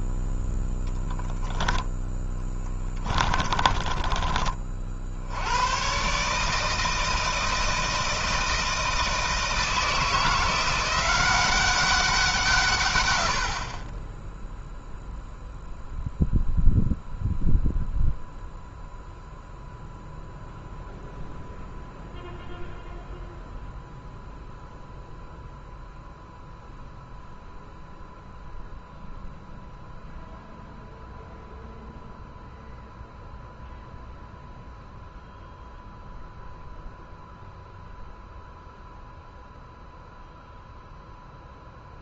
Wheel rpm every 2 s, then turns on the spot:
0, 20, 50, 160, 160, 180, 130, 0, 0, 0, 0, 0, 0, 0, 0, 0, 0, 0, 0, 0, 0.
2-4